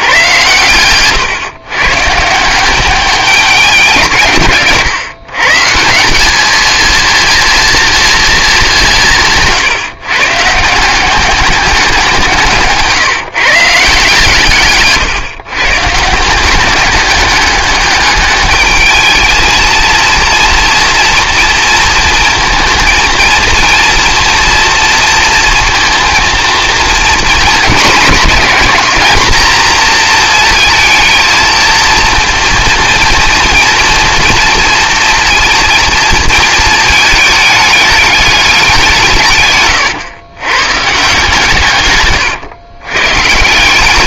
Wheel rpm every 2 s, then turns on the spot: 120, 190, 140, 230, 210, 160, 160, 150, 190, 210, 230, 230, 230, 230, 220, 230, 230, 230, 220, 190, 130, 120.
none